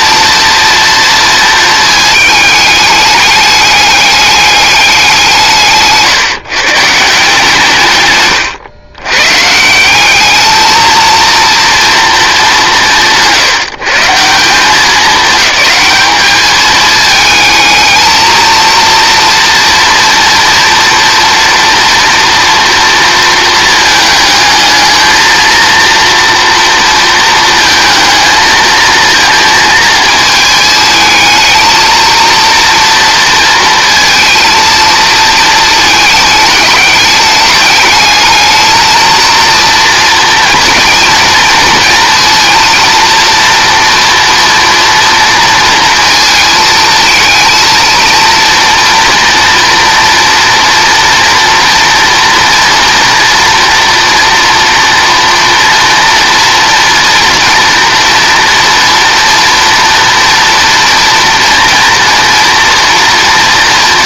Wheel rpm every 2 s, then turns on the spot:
230, 210, 200, 140, 120, 220, 190, 190, 210, 230, 240, 230, 220, 230, 220, 220, 230, 230, 210, 220, 230, 230, 230, 220, 230, 230, 230, 240, 240, 230, 230, 230.
none